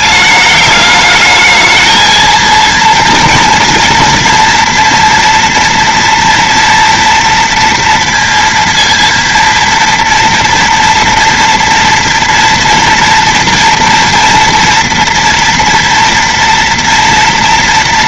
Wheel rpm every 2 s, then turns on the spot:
210, 220, 230, 230, 230, 230, 230, 230, 230.
none